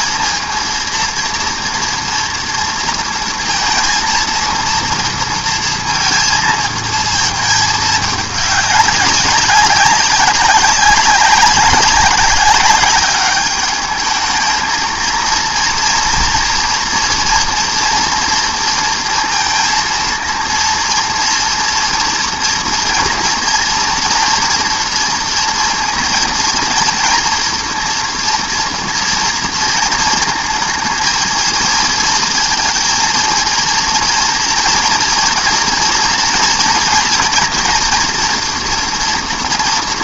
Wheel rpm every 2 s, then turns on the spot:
230, 230, 230, 220, 200, 200, 200, 220, 230, 230, 230, 230, 230, 230, 230, 220, 230, 230, 230, 230.
none